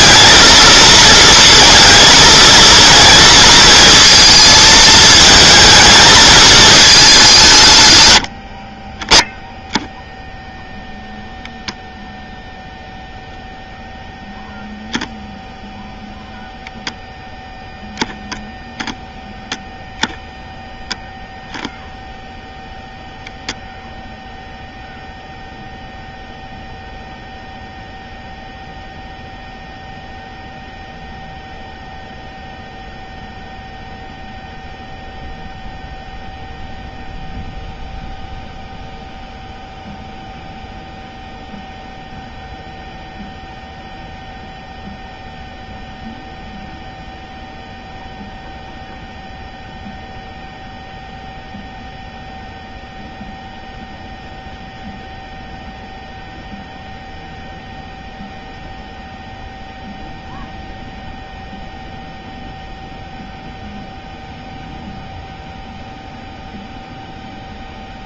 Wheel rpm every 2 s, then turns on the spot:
220, 230, 220, 220, 50, 0, 0, 0, 0, 0, 0, 0, 0, 0, 0, 0, 0, 0, 0, 0, 0, 0, 0, 0, 0, 0, 0, 0, 0, 0, 0, 0, 0, 0.
none